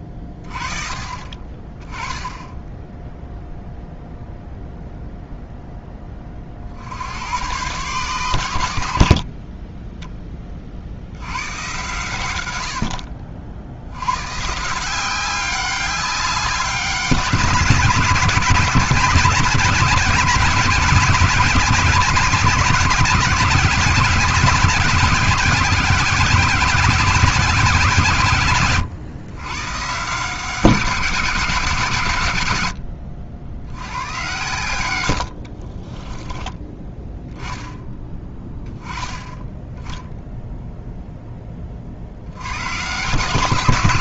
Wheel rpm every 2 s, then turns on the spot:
30, 10, 0, 60, 90, 40, 70, 160, 180, 180, 190, 190, 200, 200, 140, 180, 80, 100, 10, 10, 0, 130.
none